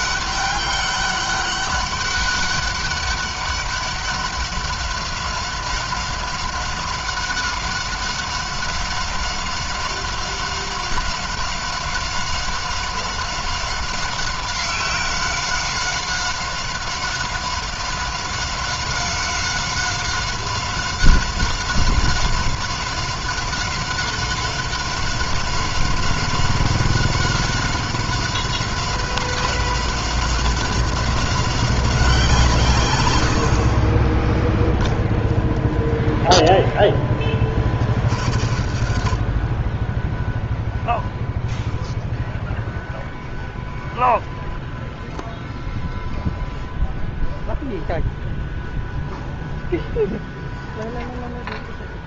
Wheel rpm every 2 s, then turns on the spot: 200, 200, 190, 190, 190, 190, 190, 190, 190, 190, 190, 190, 190, 190, 190, 190, 140, 10, 0, 90, 0, 0, 0, 0, 0, 0.
none